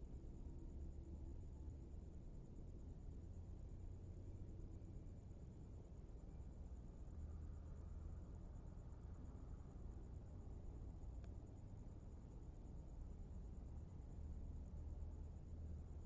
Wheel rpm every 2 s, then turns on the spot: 0, 0, 0, 0, 0, 0, 0, 0.
none